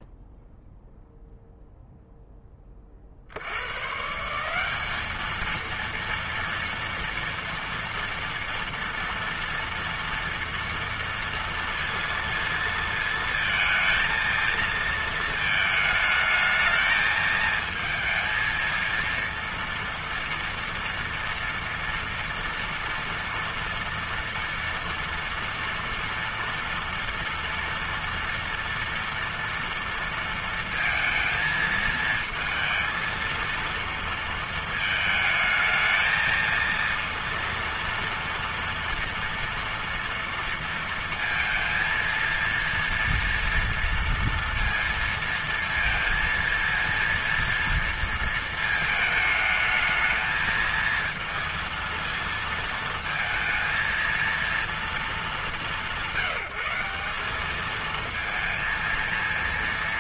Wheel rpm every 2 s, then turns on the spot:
0, 10, 170, 230, 230, 230, 230, 230, 220, 220, 230, 230, 230, 230, 230, 230, 220, 220, 230, 230, 230, 230, 230, 230, 220, 220, 230, 230, 190, 230.
none